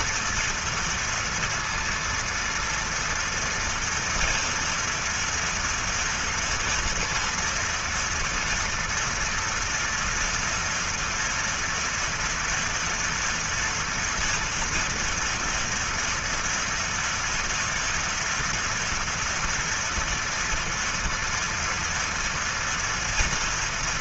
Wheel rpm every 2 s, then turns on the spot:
230, 230, 230, 240, 240, 230, 230, 230, 230, 230, 230, 230.
none